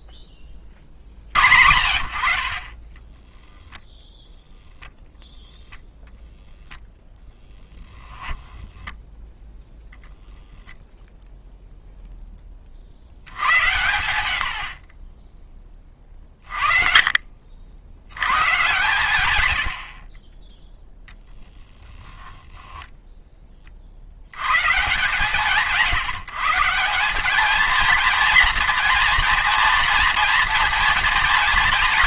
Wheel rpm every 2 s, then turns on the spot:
30, 50, 0, 0, 20, 0, 30, 90, 40, 130, 20, 10, 130, 160, 230, 240.
8-10